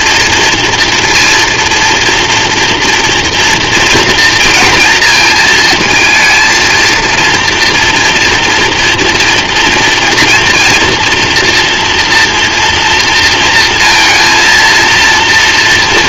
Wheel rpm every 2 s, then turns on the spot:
230, 230, 230, 230, 230, 240, 230, 230.
none